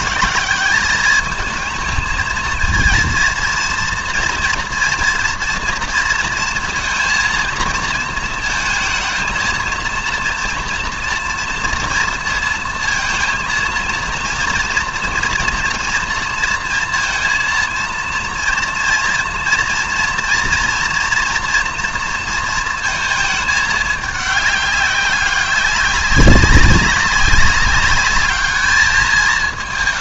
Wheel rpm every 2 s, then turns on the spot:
200, 230, 240, 230, 220, 230, 230, 230, 230, 230, 230, 230, 200, 200, 210.
none